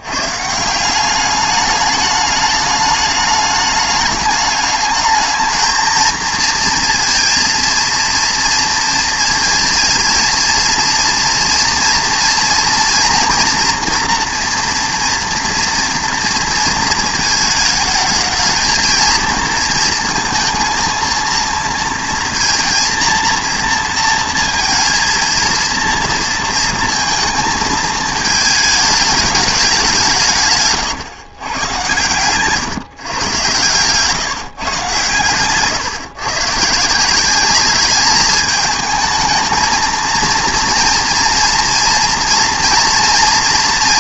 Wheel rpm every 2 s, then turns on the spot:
170, 210, 210, 230, 230, 230, 230, 230, 220, 220, 230, 230, 230, 230, 220, 140, 140, 130, 160, 220, 230, 230.
none